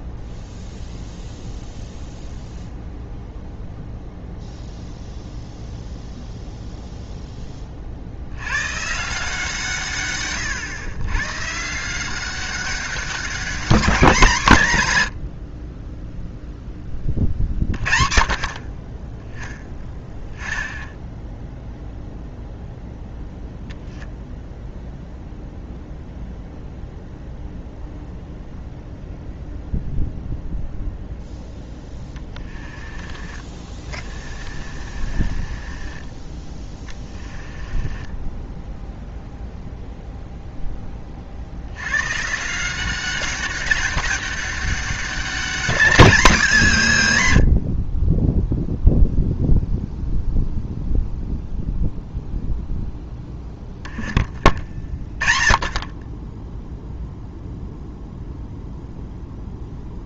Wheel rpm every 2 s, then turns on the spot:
0, 0, 0, 0, 120, 110, 190, 150, 10, 50, 0, 0, 0, 0, 0, 0, 20, 30, 10, 10, 10, 170, 200, 190, 0, 0, 0, 20, 0, 0.
32-36 38-40